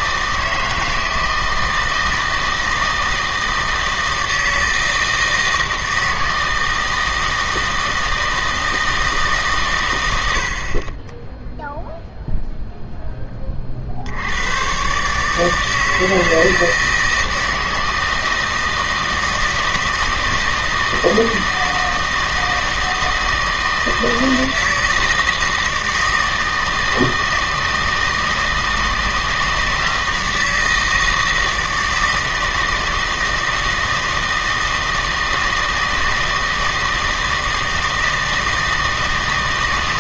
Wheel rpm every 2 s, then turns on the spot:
160, 160, 160, 160, 160, 40, 0, 110, 160, 160, 160, 160, 160, 160, 160, 160, 160, 160, 160, 160.
none